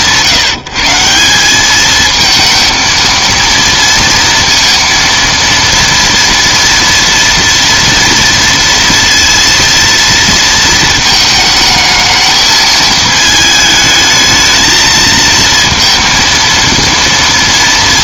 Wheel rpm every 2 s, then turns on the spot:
160, 230, 230, 230, 230, 220, 220, 220, 230.
none